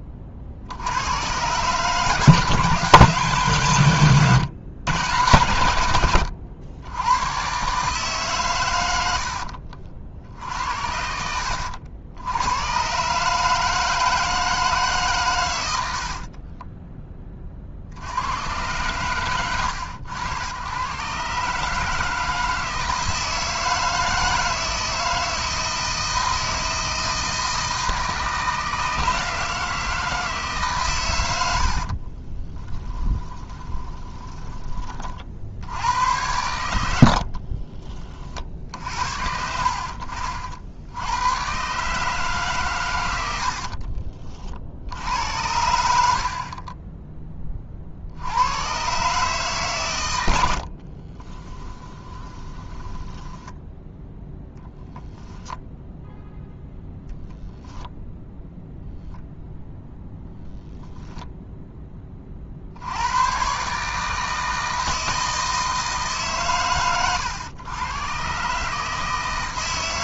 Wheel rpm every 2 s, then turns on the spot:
70, 160, 140, 90, 100, 60, 120, 150, 20, 120, 110, 160, 160, 160, 160, 140, 20, 30, 90, 60, 60, 130, 70, 20, 120, 60, 10, 10, 0, 0, 0, 70, 160, 120, 150.
16-18 32-34 36-38 50-54